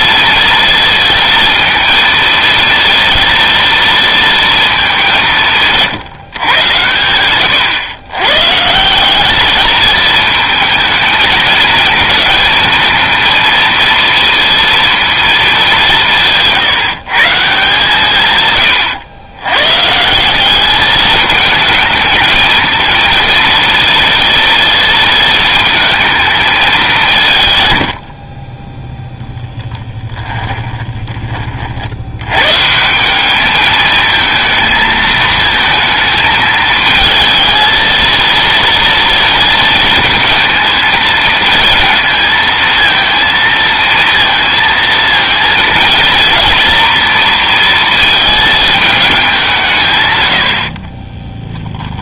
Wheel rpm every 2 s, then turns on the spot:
230, 230, 200, 110, 170, 220, 220, 230, 150, 110, 200, 220, 230, 190, 10, 20, 150, 230, 220, 240, 230, 230, 230, 230, 220, 40.
18-20 30-32 50-52